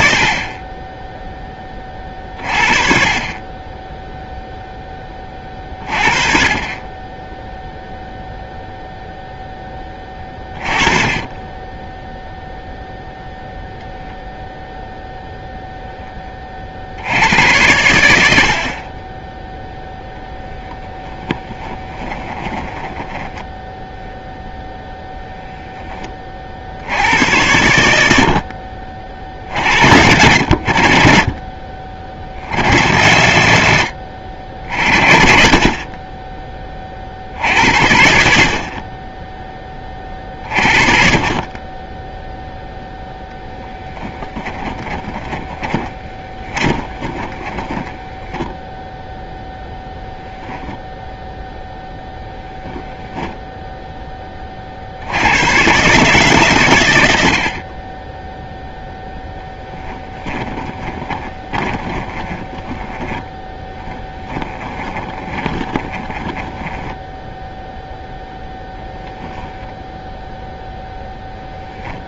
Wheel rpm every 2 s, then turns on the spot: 20, 40, 20, 30, 0, 20, 0, 0, 60, 30, 10, 20, 10, 70, 60, 60, 90, 60, 50, 40, 50, 0, 20, 30, 0, 0, 0, 60, 90, 0, 20, 20, 20, 10, 20, 0.
20-24 44-48 60-68